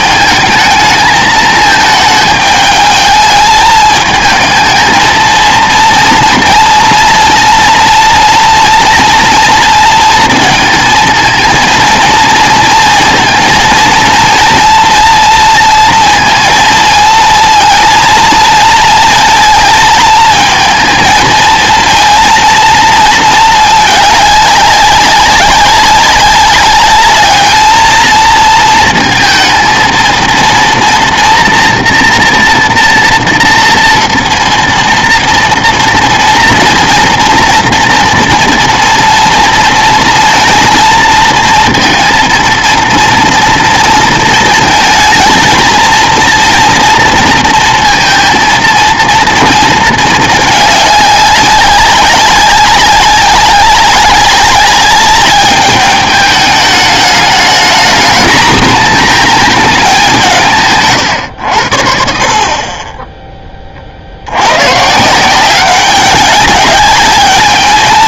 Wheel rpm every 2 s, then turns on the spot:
220, 210, 220, 230, 230, 220, 230, 230, 230, 230, 220, 230, 200, 200, 220, 230, 240, 230, 230, 230, 230, 230, 220, 230, 230, 200, 190, 200, 210, 220, 140, 30, 130, 200.
none